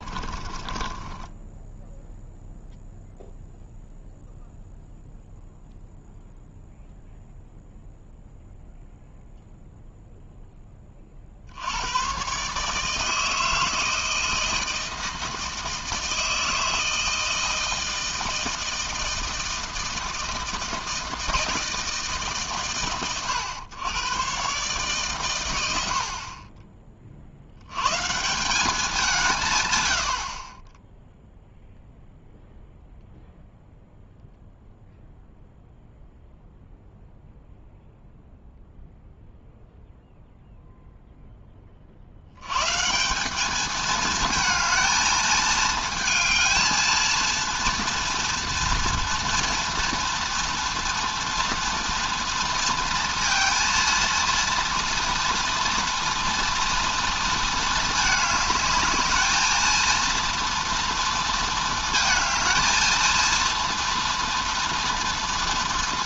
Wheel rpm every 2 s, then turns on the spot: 20, 0, 0, 0, 0, 10, 150, 160, 160, 160, 160, 110, 130, 20, 190, 20, 0, 0, 0, 0, 0, 140, 220, 220, 230, 230, 230, 240, 230, 210, 230, 230, 230.
0-2